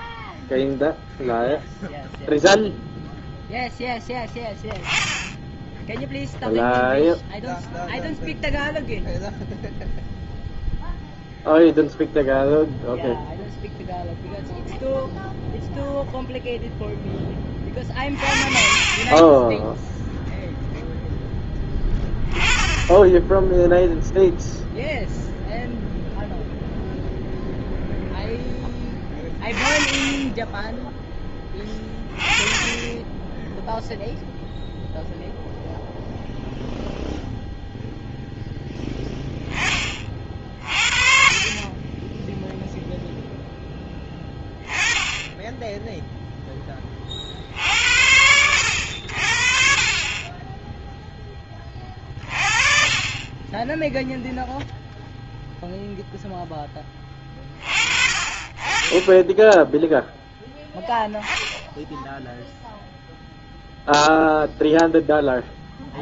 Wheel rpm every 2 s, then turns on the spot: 0, 0, 0, 0, 0, 0, 0, 0, 0, 40, 0, 10, 0, 0, 10, 10, 20, 0, 0, 0, 30, 0, 10, 10, 80, 10, 40, 0, 10, 20, 0, 0, 0.
none